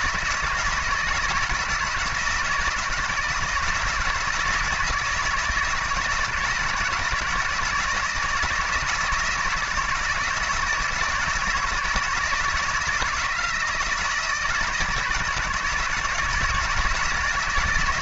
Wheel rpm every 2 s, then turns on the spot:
160, 160, 160, 160, 160, 160, 170, 160, 160.
none